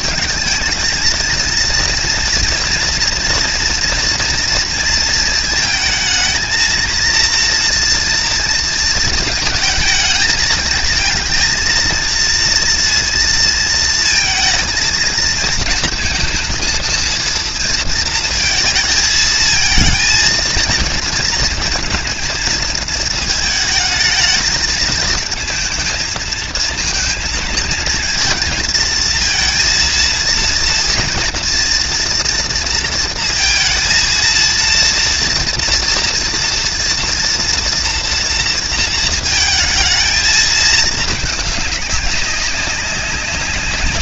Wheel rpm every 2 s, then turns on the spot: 220, 230, 230, 230, 220, 220, 230, 220, 230, 220, 230, 220, 220, 230, 220, 230, 230, 230, 230, 230, 220, 200.
none